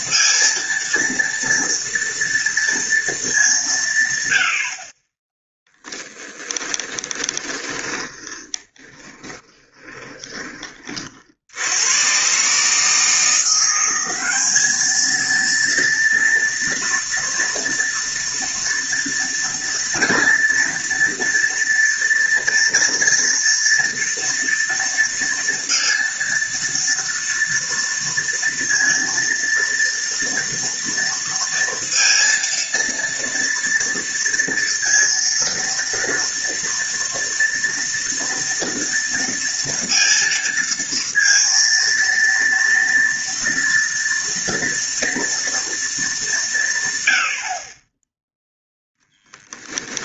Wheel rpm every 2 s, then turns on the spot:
230, 230, 50, 10, 20, 40, 150, 210, 230, 230, 230, 230, 230, 230, 230, 230, 230, 230, 230, 230, 230, 230, 230, 150, 0.
6-10